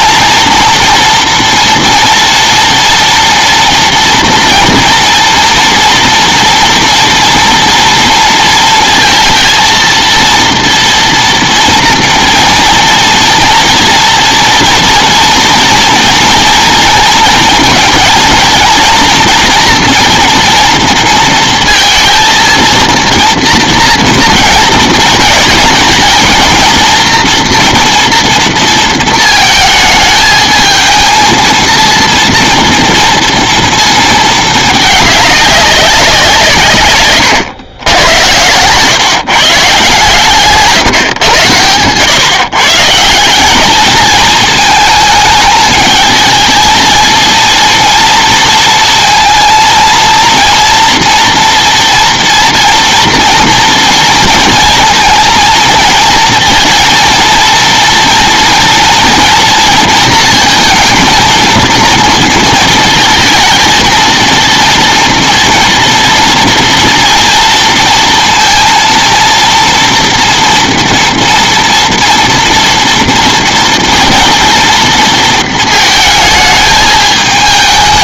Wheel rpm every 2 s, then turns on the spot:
230, 230, 230, 240, 230, 230, 230, 230, 230, 230, 230, 230, 230, 230, 230, 220, 230, 220, 150, 100, 140, 130, 220, 220, 230, 230, 230, 230, 230, 230, 230, 230, 230, 230, 230, 230, 230, 230, 220.
none